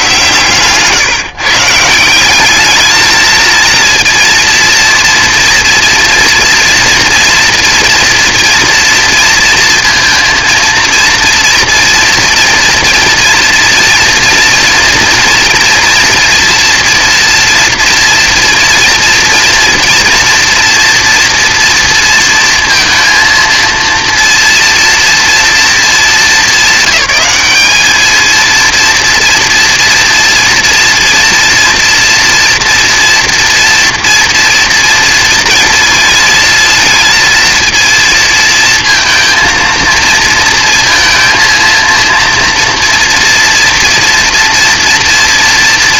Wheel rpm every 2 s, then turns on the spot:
140, 210, 230, 230, 230, 230, 230, 240, 230, 230, 230, 230, 230, 200, 230, 240, 230, 230, 230, 230, 230, 230, 230.
none